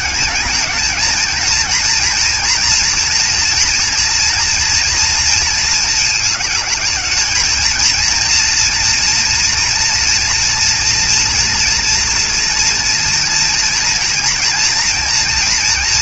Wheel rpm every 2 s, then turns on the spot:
220, 230, 230, 210, 230, 230, 230, 230.
none